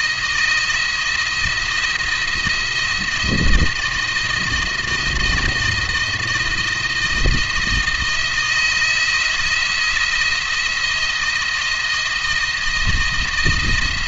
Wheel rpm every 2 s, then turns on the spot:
170, 170, 160, 170, 170, 170, 170.
none